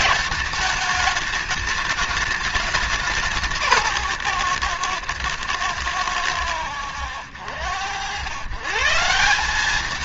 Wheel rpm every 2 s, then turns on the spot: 210, 200, 130, 100, 130.
none